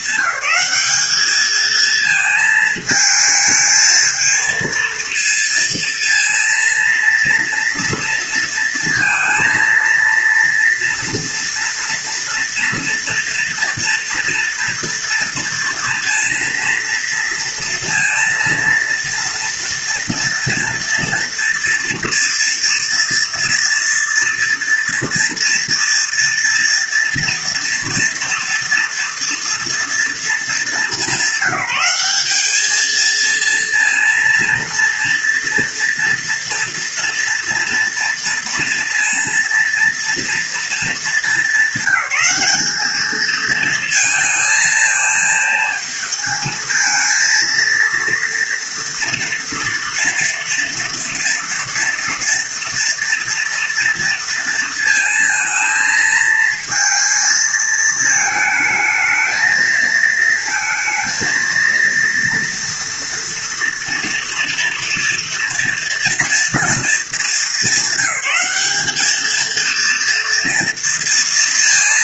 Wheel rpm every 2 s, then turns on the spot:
200, 220, 230, 230, 230, 230, 230, 230, 230, 230, 230, 240, 230, 230, 230, 210, 220, 230, 230, 240, 220, 210, 220, 230, 230, 230, 230, 230, 220, 220, 220, 230, 230, 220, 210, 230.
none